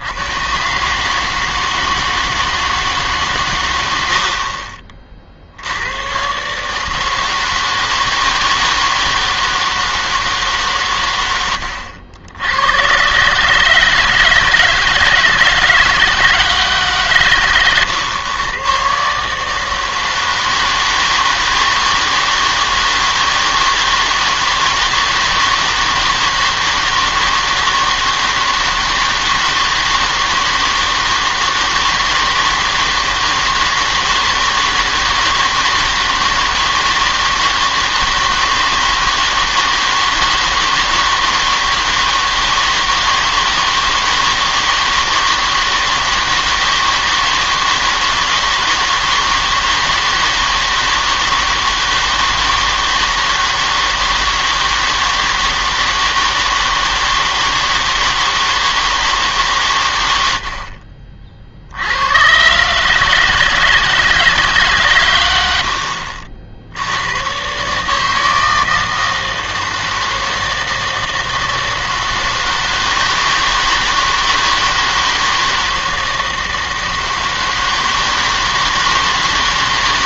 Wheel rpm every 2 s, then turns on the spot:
130, 160, 50, 140, 160, 140, 100, 160, 150, 120, 160, 160, 160, 160, 160, 160, 160, 160, 160, 160, 160, 160, 160, 160, 160, 160, 160, 160, 160, 160, 70, 140, 140, 70, 160, 160, 160, 160, 160, 160.
4-6